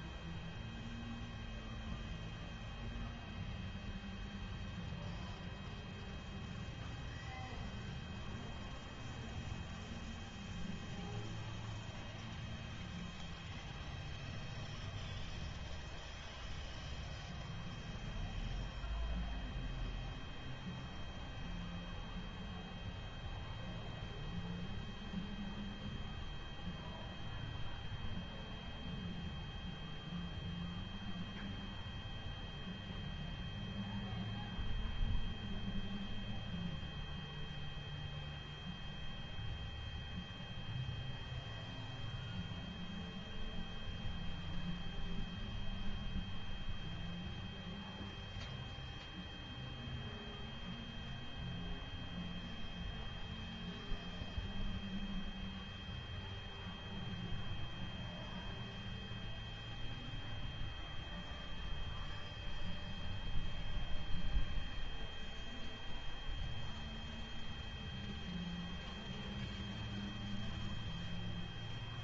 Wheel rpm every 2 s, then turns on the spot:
0, 0, 0, 0, 0, 0, 0, 0, 0, 0, 0, 0, 0, 0, 0, 0, 0, 0, 0, 0, 0, 0, 0, 0, 0, 0, 0, 0, 0, 0, 0, 0, 0, 0, 0, 0.
none